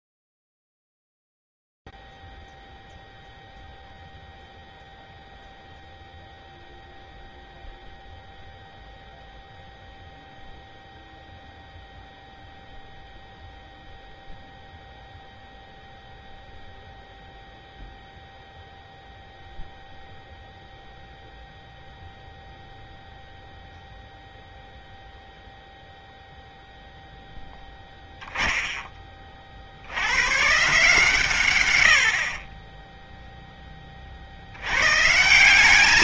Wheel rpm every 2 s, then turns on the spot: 0, 0, 0, 0, 0, 0, 0, 0, 0, 0, 0, 0, 0, 0, 0, 130, 40, 70.
none